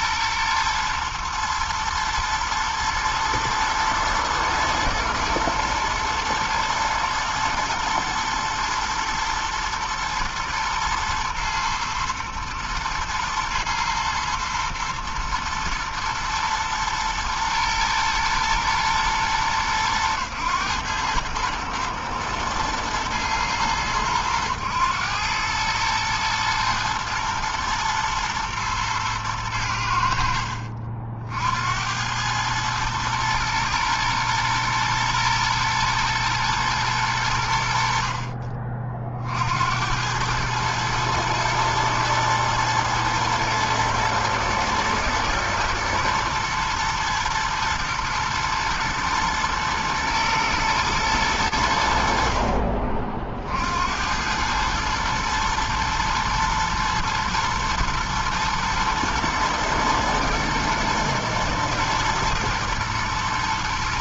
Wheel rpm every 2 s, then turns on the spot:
120, 120, 110, 120, 110, 120, 110, 120, 110, 120, 110, 110, 100, 110, 120, 70, 100, 120, 110, 50, 100, 110, 110, 110, 110, 110, 60, 90, 120, 110, 120, 120.
none